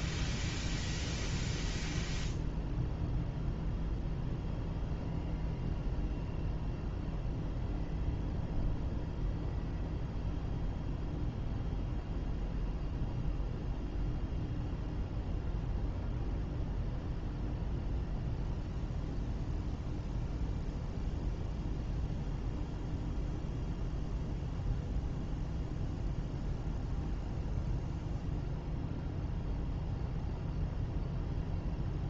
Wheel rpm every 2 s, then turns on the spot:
0, 0, 0, 0, 0, 0, 0, 0, 0, 0, 0, 0, 0, 0, 0, 0.
none